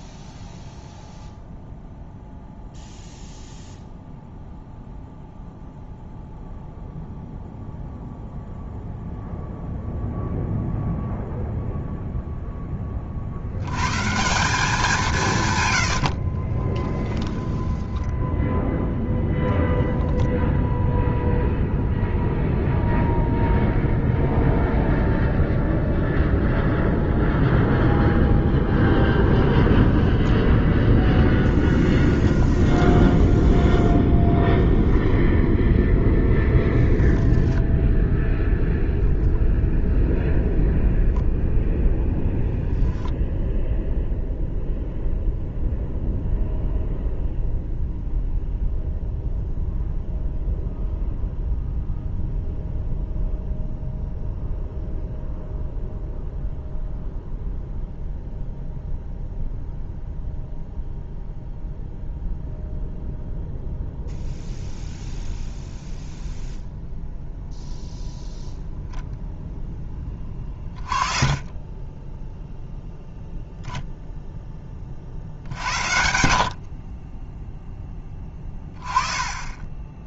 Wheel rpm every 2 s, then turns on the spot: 0, 0, 0, 0, 0, 0, 20, 180, 20, 0, 0, 0, 0, 0, 10, 10, 10, 0, 10, 0, 0, 10, 0, 0, 0, 0, 0, 0, 0, 0, 0, 0, 0, 0, 0, 30, 0, 30, 40, 20.
16-18 32-34 36-38